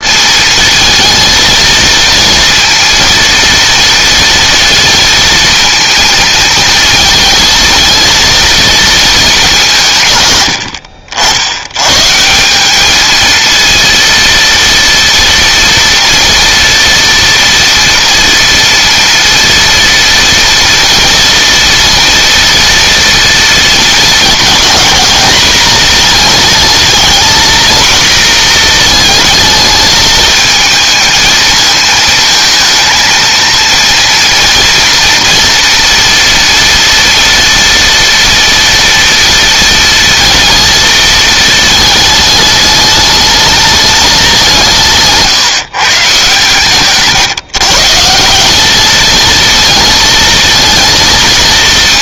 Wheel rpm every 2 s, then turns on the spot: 230, 230, 230, 220, 220, 70, 210, 230, 230, 230, 230, 240, 220, 220, 230, 220, 230, 240, 230, 230, 230, 210, 160, 140, 210, 230.
none